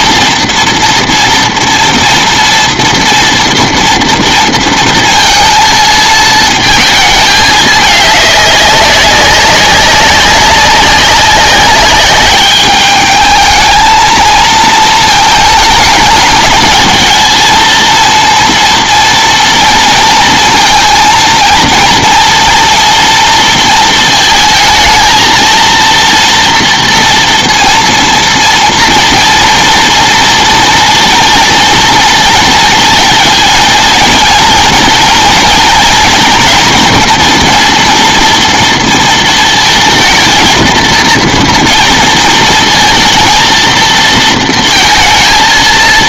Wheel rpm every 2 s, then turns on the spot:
230, 230, 230, 220, 200, 190, 210, 230, 220, 230, 230, 230, 220, 230, 230, 230, 230, 230, 230, 230, 220, 230, 230.
none